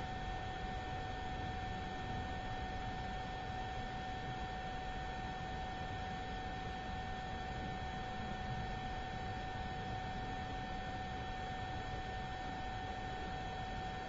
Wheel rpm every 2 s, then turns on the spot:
0, 0, 0, 0, 0, 0, 0.
none